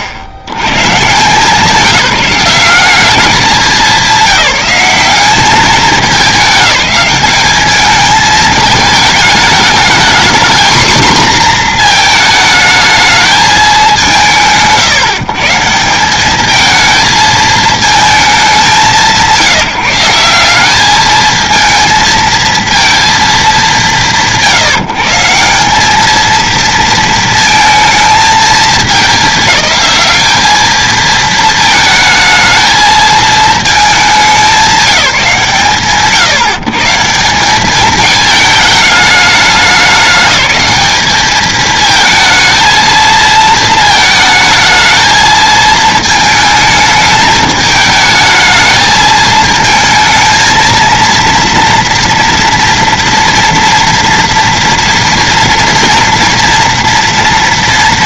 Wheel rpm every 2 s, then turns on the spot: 90, 180, 190, 210, 220, 240, 220, 130, 220, 200, 190, 220, 140, 230, 210, 220, 220, 190, 150, 210, 210, 220, 220, 220, 220, 230, 230, 240, 230.
none